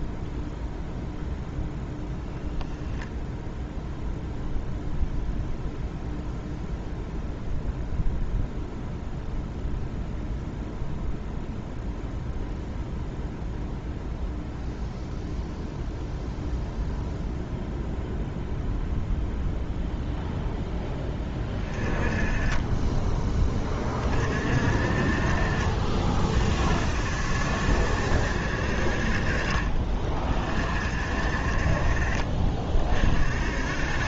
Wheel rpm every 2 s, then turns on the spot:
0, 0, 0, 0, 0, 0, 0, 0, 0, 0, 10, 20, 50, 50, 60, 50, 40.
none